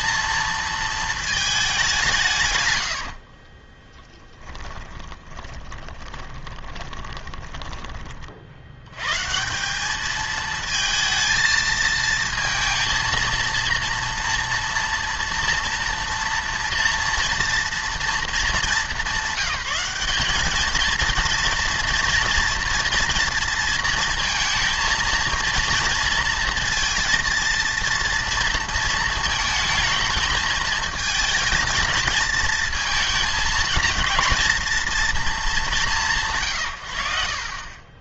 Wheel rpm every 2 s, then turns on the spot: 230, 100, 20, 20, 90, 230, 230, 230, 230, 210, 220, 240, 230, 230, 230, 220, 230, 230, 120.
2-8